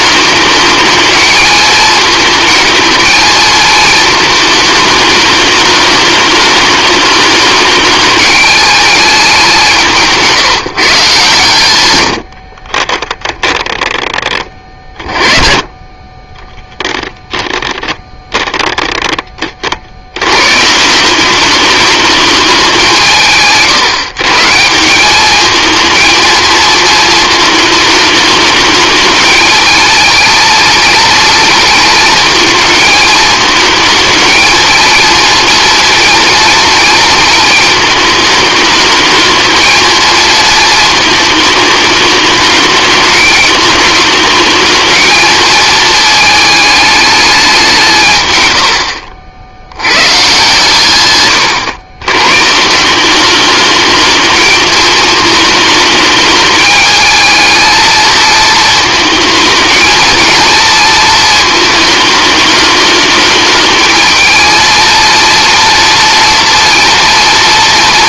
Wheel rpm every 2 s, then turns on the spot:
220, 220, 210, 210, 210, 140, 30, 30, 10, 10, 160, 180, 180, 230, 210, 220, 220, 230, 230, 220, 220, 210, 220, 210, 80, 130, 180, 220, 210, 220, 220, 210, 230, 230.
12-14